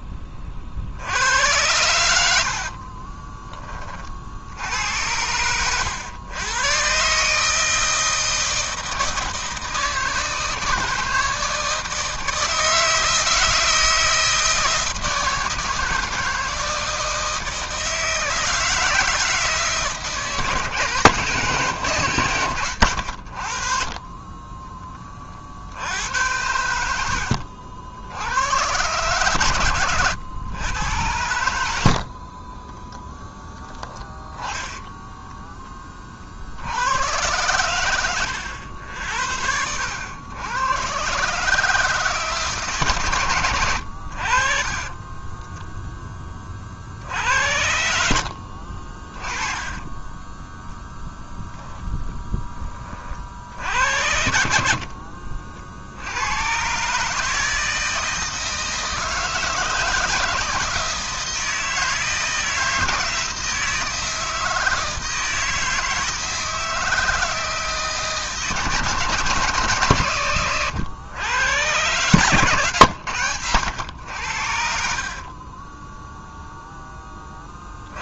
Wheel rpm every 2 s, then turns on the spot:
40, 70, 70, 110, 160, 160, 160, 160, 160, 160, 150, 100, 20, 90, 100, 100, 30, 10, 70, 90, 110, 150, 50, 30, 60, 30, 10, 70, 110, 160, 160, 160, 160, 160, 150, 120, 130, 70, 0.
2-4 32-34 48-52 70-72